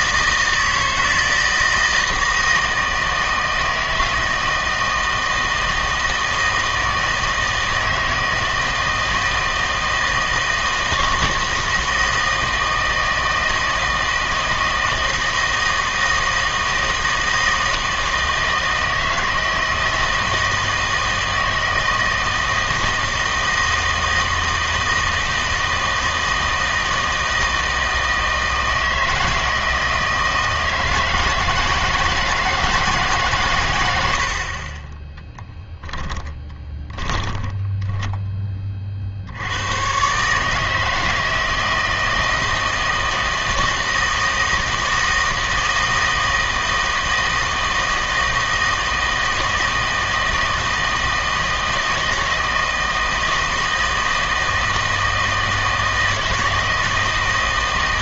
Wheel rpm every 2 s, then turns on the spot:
160, 160, 160, 160, 160, 160, 160, 160, 160, 160, 160, 160, 160, 160, 160, 160, 160, 30, 10, 30, 150, 160, 160, 160, 160, 160, 160, 160, 160.
34-38